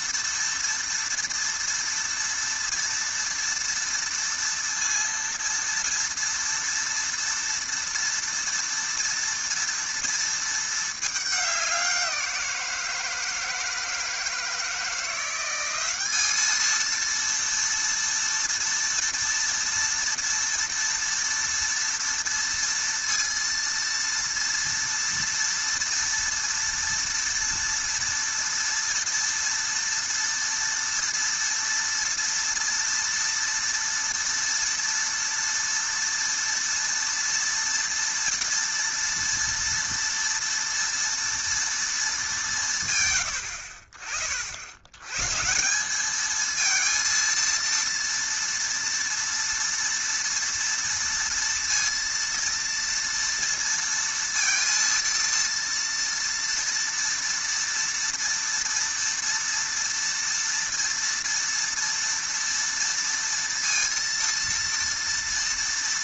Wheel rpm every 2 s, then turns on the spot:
230, 230, 230, 230, 230, 220, 170, 160, 220, 230, 230, 230, 230, 230, 230, 230, 230, 230, 230, 230, 230, 160, 80, 220, 230, 230, 230, 230, 230, 230, 230, 230, 230.
none